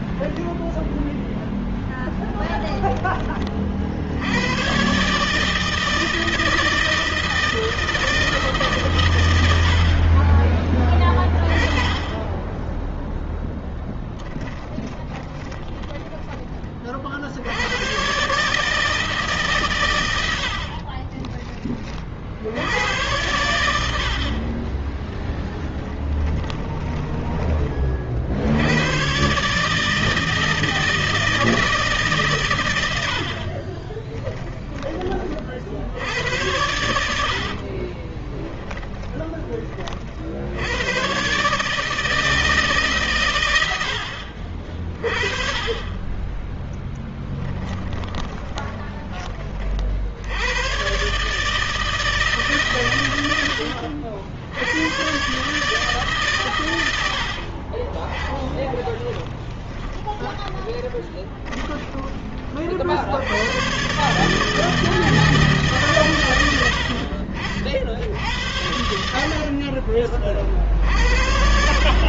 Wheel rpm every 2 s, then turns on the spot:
10, 20, 140, 160, 140, 20, 10, 20, 40, 150, 40, 110, 20, 10, 110, 160, 80, 30, 80, 10, 110, 140, 40, 10, 20, 130, 120, 110, 80, 10, 30, 70, 160, 60, 70, 50.
14-16 20-22 24-28 36-40 58-62